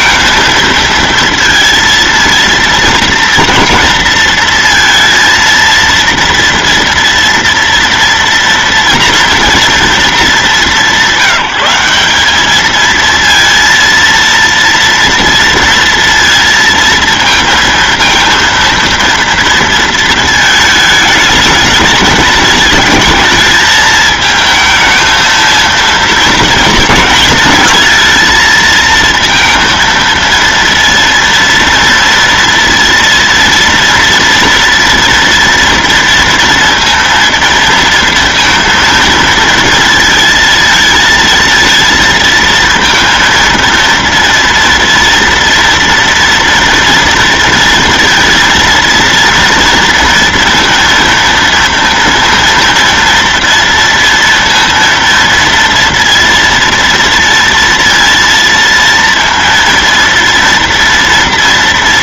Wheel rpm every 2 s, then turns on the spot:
230, 230, 230, 230, 230, 190, 220, 230, 230, 230, 220, 220, 220, 220, 230, 230, 230, 230, 230, 230, 230, 230, 230, 230, 230, 230, 230, 230, 230, 230, 230.
none